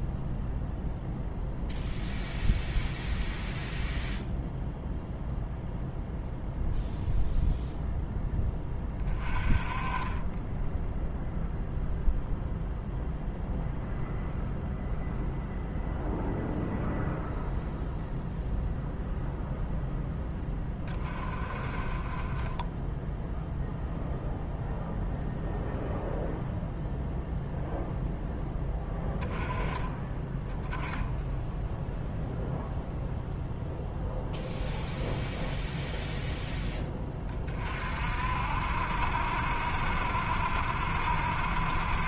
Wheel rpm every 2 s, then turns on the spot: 0, 0, 0, 0, 20, 0, 0, 0, 0, 0, 20, 10, 0, 0, 10, 10, 0, 0, 10, 60, 70.
none